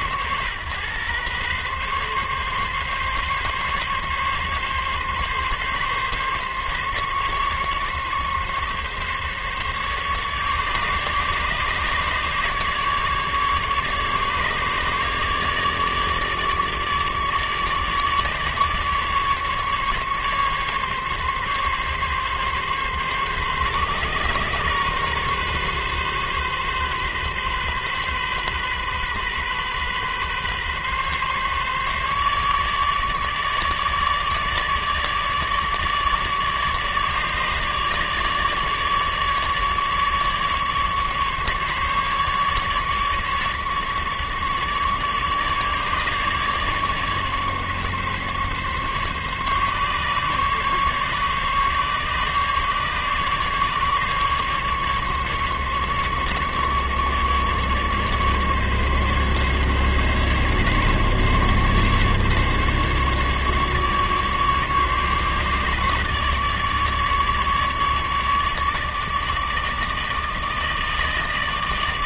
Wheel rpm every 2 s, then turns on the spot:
120, 140, 140, 140, 140, 150, 150, 150, 150, 150, 140, 140, 140, 130, 130, 140, 150, 150, 150, 150, 150, 150, 150, 150, 140, 140, 140, 140, 150, 140, 140, 140, 140, 150, 150, 160.
none